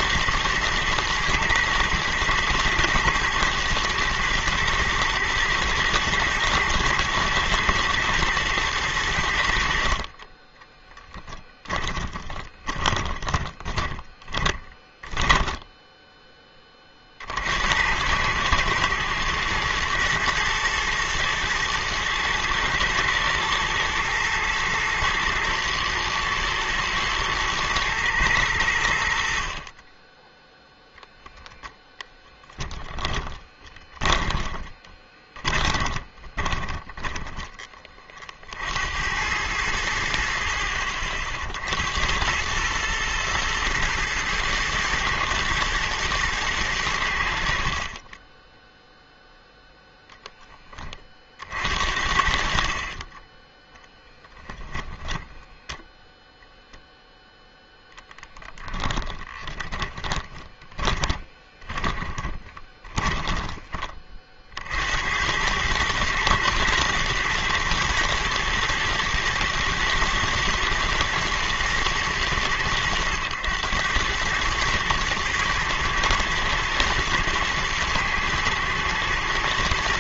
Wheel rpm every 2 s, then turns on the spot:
110, 110, 120, 120, 100, 10, 20, 10, 60, 110, 110, 120, 110, 110, 80, 0, 10, 20, 10, 90, 50, 110, 110, 90, 0, 30, 30, 20, 0, 10, 20, 20, 80, 110, 120, 110, 100, 110, 110, 120.
10-16 32-38 54-56 58-64